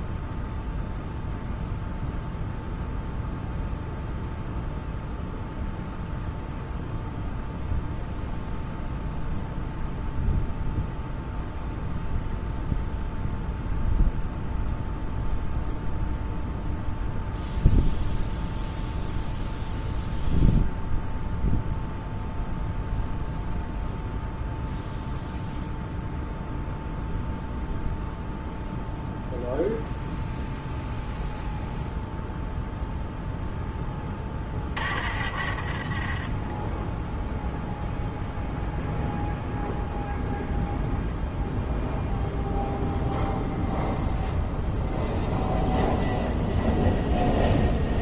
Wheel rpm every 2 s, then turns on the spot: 0, 0, 0, 0, 0, 0, 0, 0, 0, 0, 0, 0, 0, 0, 0, 0, 0, 30, 10, 0, 0, 0, 0, 0.
none